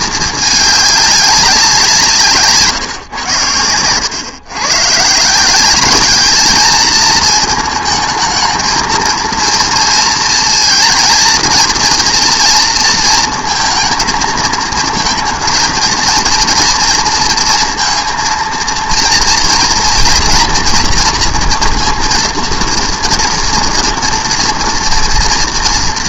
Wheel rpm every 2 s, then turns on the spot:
210, 140, 130, 220, 220, 230, 230, 220, 230, 230, 240, 230, 230.
none